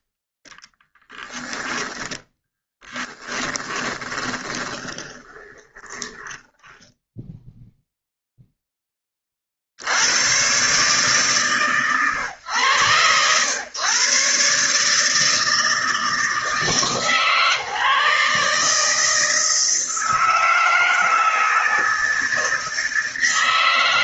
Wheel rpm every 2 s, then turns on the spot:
10, 10, 20, 10, 20, 140, 110, 140, 150, 150, 160, 160.
2-8